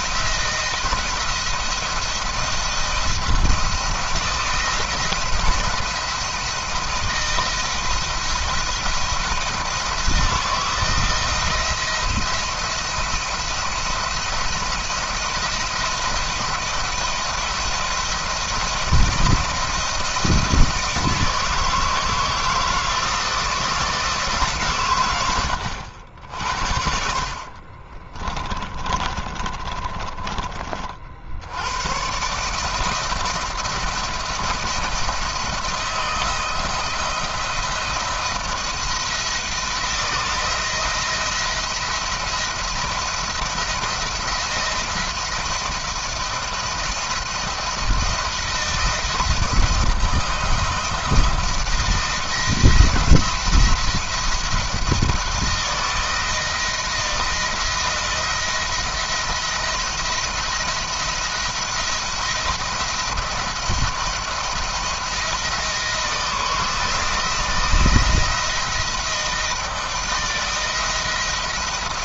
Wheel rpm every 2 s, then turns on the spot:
170, 170, 170, 170, 170, 170, 170, 170, 170, 170, 160, 160, 120, 70, 30, 50, 160, 170, 170, 170, 170, 170, 170, 170, 170, 170, 170, 160, 160, 170, 170, 170, 170, 170, 160, 170.
26-30